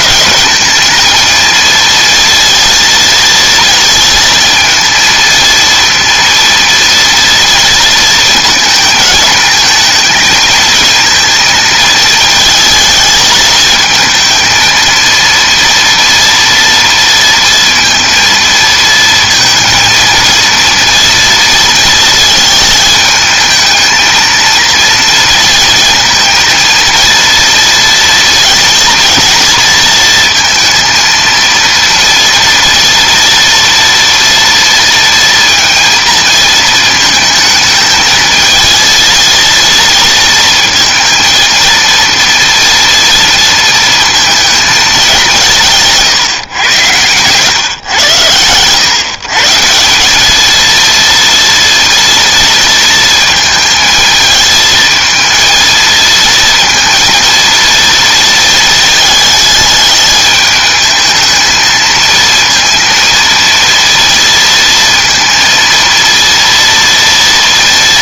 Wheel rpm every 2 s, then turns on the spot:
220, 230, 230, 230, 220, 220, 220, 220, 230, 230, 230, 220, 230, 230, 230, 230, 240, 230, 220, 220, 230, 230, 220, 120, 110, 220, 230, 220, 230, 220, 210, 230, 230, 230.
none